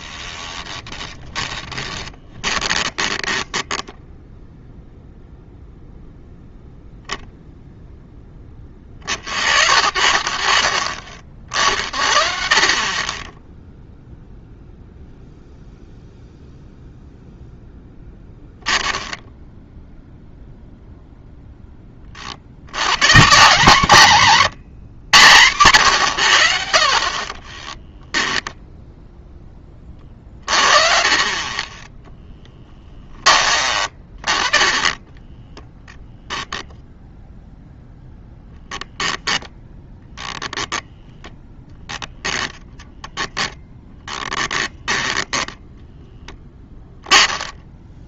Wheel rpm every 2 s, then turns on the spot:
10, 20, 0, 0, 20, 50, 40, 0, 0, 10, 0, 90, 150, 60, 0, 30, 10, 20, 0, 0, 10, 0, 10, 10.
0-4 34-36